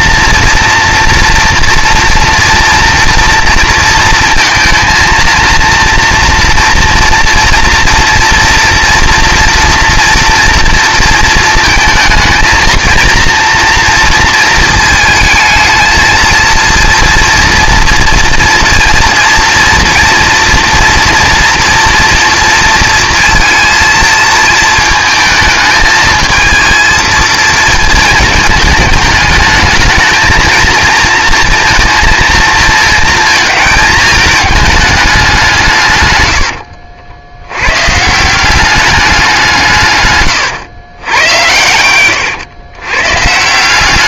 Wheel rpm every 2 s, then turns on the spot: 230, 240, 230, 240, 240, 230, 230, 230, 230, 240, 230, 230, 220, 230, 210, 220, 230, 210, 80, 190, 110, 110.
36-38